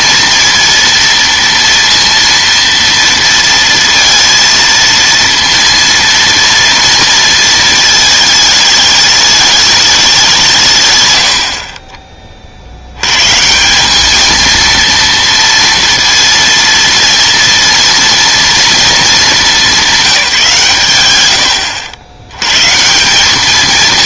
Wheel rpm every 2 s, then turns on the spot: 230, 230, 230, 230, 220, 140, 70, 230, 230, 230, 150, 140.
none